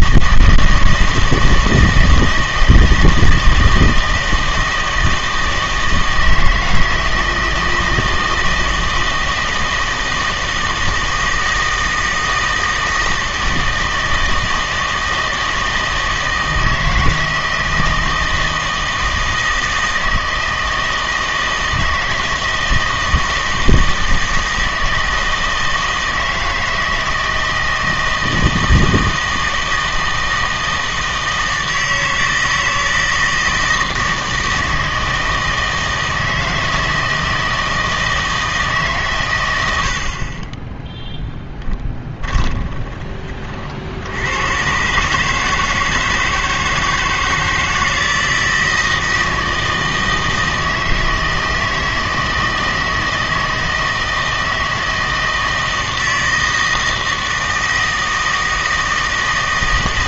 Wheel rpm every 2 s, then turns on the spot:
160, 160, 160, 160, 160, 160, 160, 160, 160, 160, 160, 160, 160, 160, 160, 160, 160, 160, 160, 150, 10, 20, 120, 160, 160, 160, 160, 160, 160, 160.
42-44